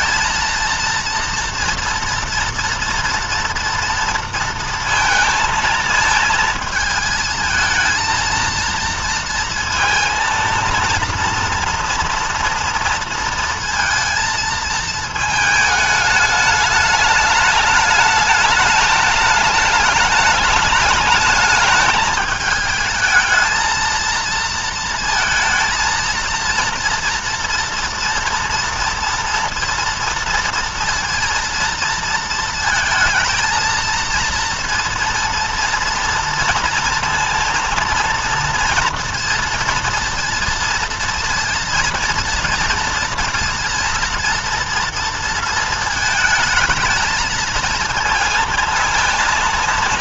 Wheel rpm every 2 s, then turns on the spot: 230, 230, 230, 220, 230, 230, 230, 220, 210, 210, 210, 210, 230, 230, 230, 230, 230, 230, 230, 230, 230, 230, 230, 220, 220.
none